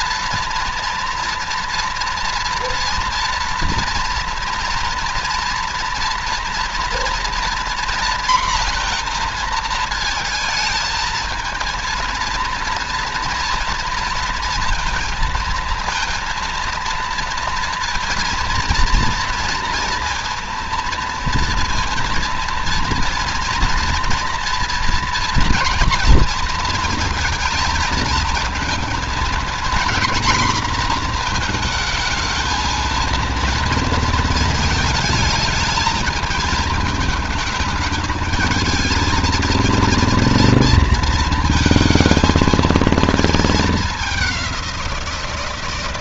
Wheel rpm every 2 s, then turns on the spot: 230, 230, 230, 230, 240, 230, 230, 230, 230, 230, 230, 230, 230, 230, 230, 220, 220, 220, 220, 220, 230, 220, 200.
none